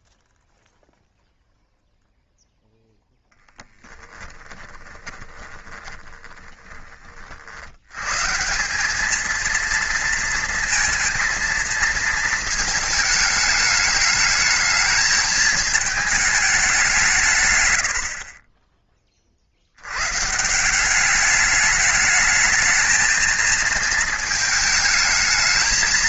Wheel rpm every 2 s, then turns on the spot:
0, 0, 10, 20, 180, 230, 220, 220, 200, 20, 170, 220, 220.
4-6